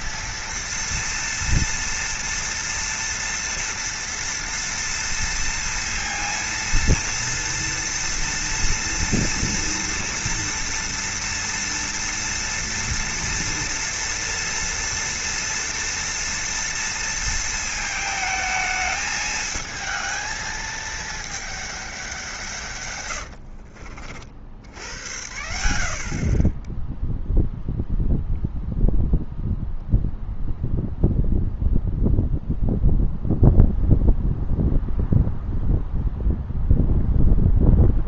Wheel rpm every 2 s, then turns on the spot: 230, 230, 230, 230, 230, 230, 230, 230, 230, 220, 220, 130, 80, 10, 0, 0, 0, 0, 0.
22-24